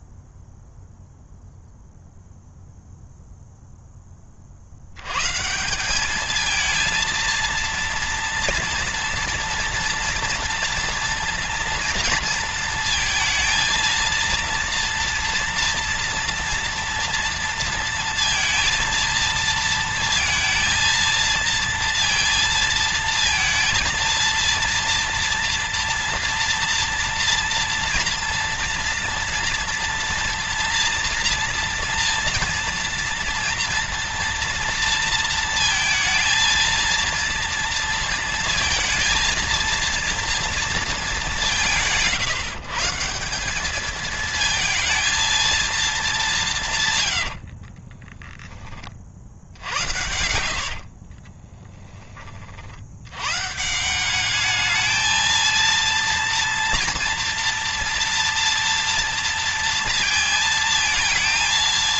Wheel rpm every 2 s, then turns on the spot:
0, 0, 50, 220, 230, 230, 230, 230, 230, 230, 230, 230, 230, 230, 230, 230, 230, 230, 230, 230, 230, 140, 220, 170, 20, 70, 50, 200, 230, 230, 230.
50-52